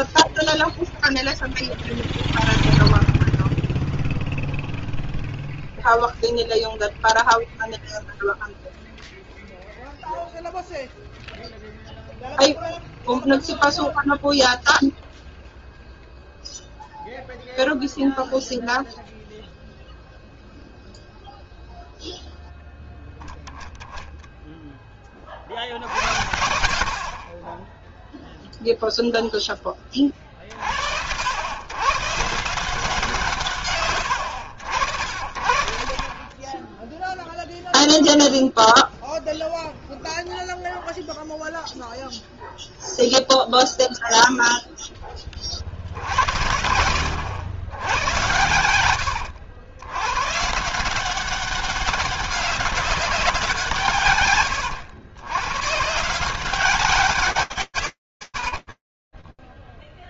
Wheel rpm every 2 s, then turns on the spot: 0, 0, 0, 0, 0, 0, 0, 0, 0, 0, 0, 0, 20, 40, 0, 80, 170, 70, 10, 0, 0, 0, 10, 100, 100, 180, 190, 120, 130, 0.
none